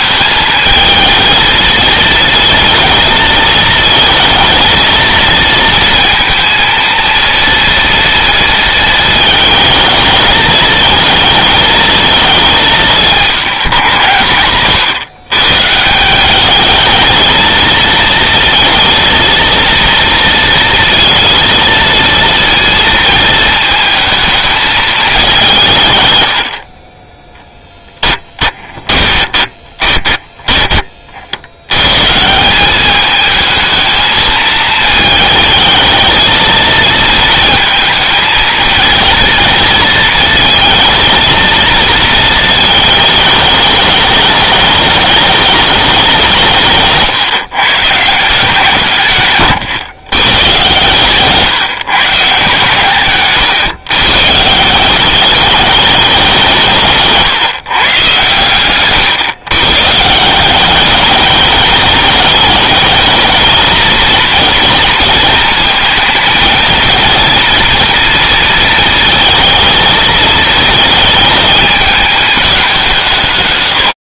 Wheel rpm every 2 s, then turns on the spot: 230, 230, 230, 230, 220, 220, 180, 120, 220, 230, 230, 220, 210, 40, 20, 40, 210, 220, 230, 230, 230, 220, 210, 150, 150, 140, 130, 190, 160, 130, 200, 220, 230, 230, 230, 220, 170.
26-30